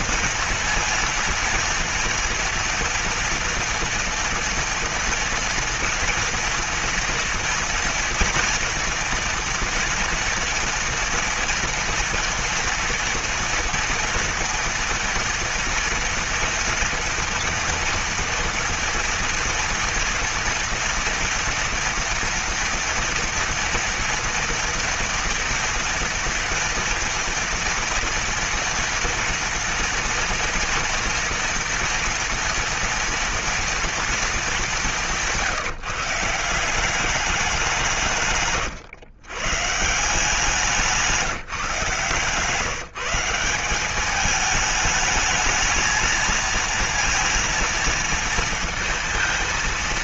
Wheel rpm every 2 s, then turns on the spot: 230, 230, 230, 240, 240, 240, 230, 230, 230, 240, 240, 230, 230, 230, 230, 230, 230, 210, 170, 140, 170, 150, 210, 230, 230.
38-40